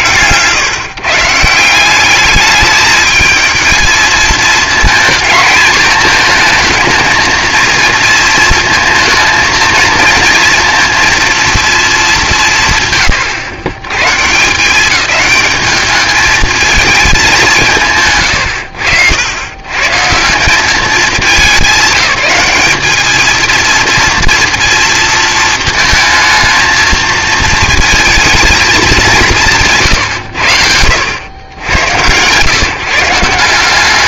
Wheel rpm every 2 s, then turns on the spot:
140, 210, 230, 230, 230, 230, 140, 180, 220, 80, 210, 210, 230, 230, 210, 80, 150.
none